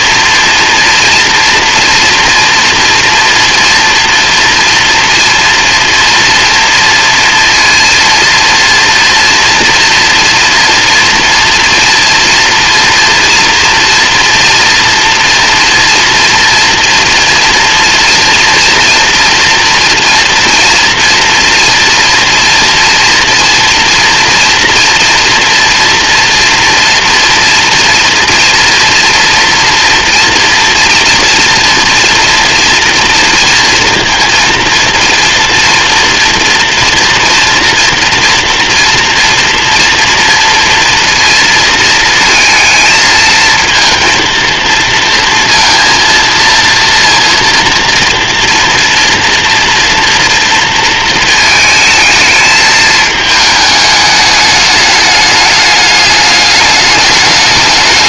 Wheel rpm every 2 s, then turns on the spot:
230, 230, 230, 230, 230, 230, 240, 230, 240, 230, 230, 230, 230, 240, 230, 230, 230, 230, 230, 240, 230, 220, 230, 230, 230, 230, 220, 210, 210.
none